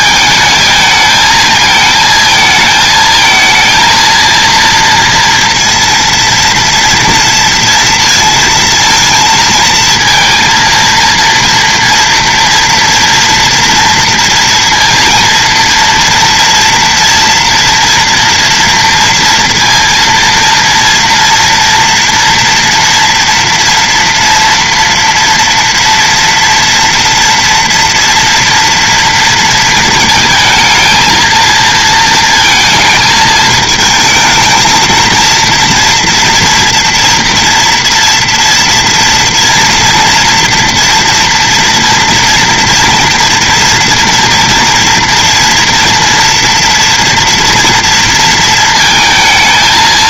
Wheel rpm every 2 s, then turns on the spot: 220, 220, 230, 230, 230, 230, 230, 230, 230, 230, 230, 230, 240, 230, 230, 220, 220, 230, 230, 230, 230, 230, 230, 230, 230.
none